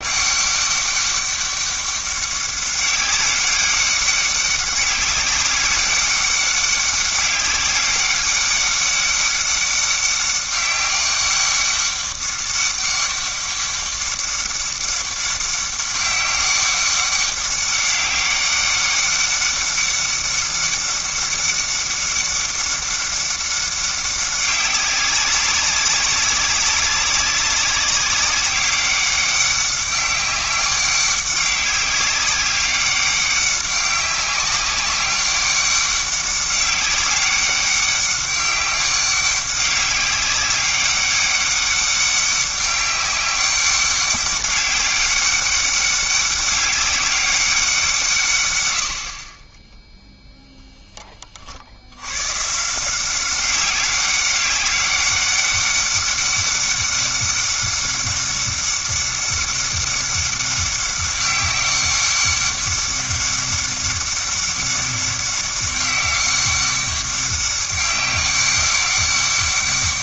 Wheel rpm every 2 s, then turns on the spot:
200, 200, 190, 200, 200, 200, 200, 200, 200, 200, 200, 200, 190, 190, 200, 200, 200, 200, 200, 200, 200, 200, 200, 200, 80, 10, 150, 200, 200, 200, 200, 200, 200, 200, 190.
none